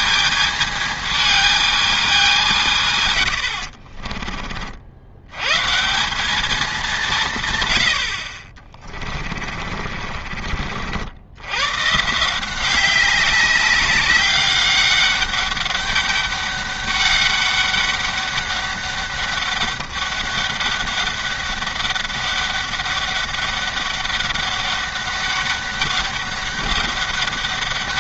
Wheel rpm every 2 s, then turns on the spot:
220, 160, 50, 210, 40, 50, 190, 200, 200, 200, 200, 200, 200, 200.
8-10